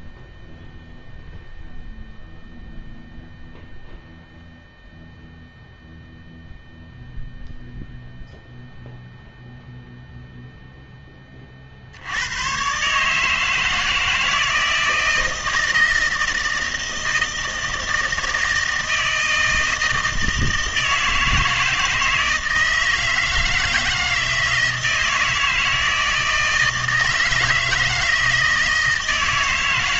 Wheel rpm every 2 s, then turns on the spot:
0, 0, 0, 0, 0, 0, 120, 160, 160, 160, 160, 160, 160, 160, 160.
none